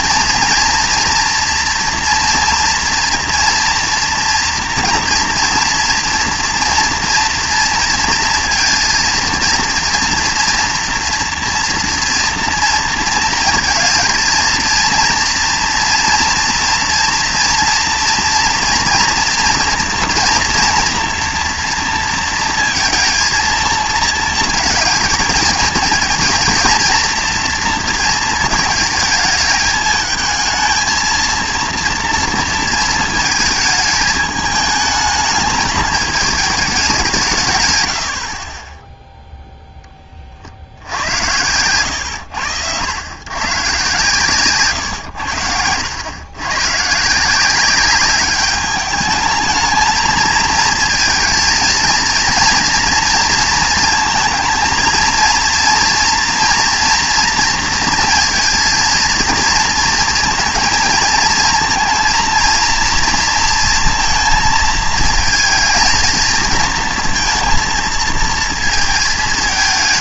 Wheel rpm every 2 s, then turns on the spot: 230, 230, 230, 230, 230, 240, 230, 220, 240, 230, 230, 230, 230, 230, 220, 220, 230, 220, 210, 20, 60, 90, 130, 120, 200, 220, 230, 230, 240, 230, 230, 230, 220, 230, 230.
none